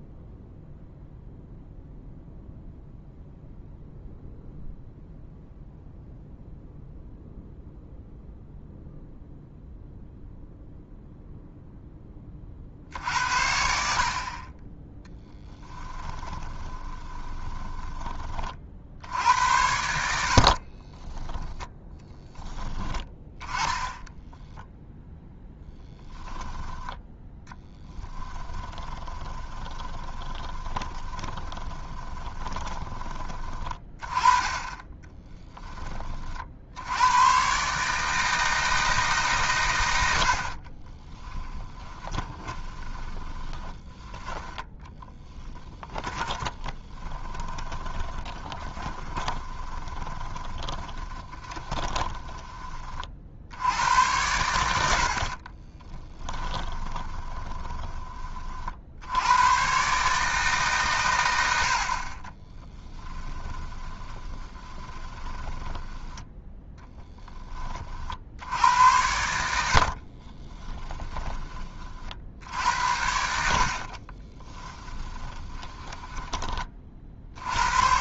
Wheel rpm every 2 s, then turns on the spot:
0, 0, 0, 0, 0, 0, 50, 10, 20, 60, 40, 10, 10, 10, 20, 30, 20, 20, 80, 160, 30, 20, 10, 30, 20, 20, 30, 80, 20, 60, 130, 10, 20, 10, 80, 30, 80, 10, 40.
16-18 20-22 24-26 28-36 40-52 56-58 62-66 74-76